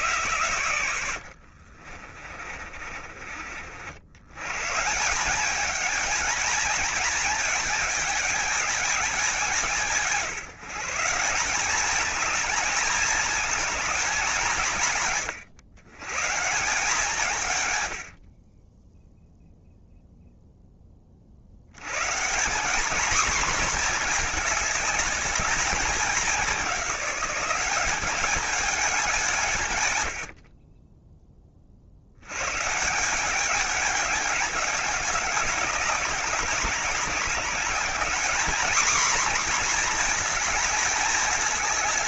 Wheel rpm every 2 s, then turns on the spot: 110, 40, 150, 220, 210, 170, 220, 160, 160, 10, 10, 200, 220, 200, 210, 30, 150, 200, 200, 230, 220.
2-4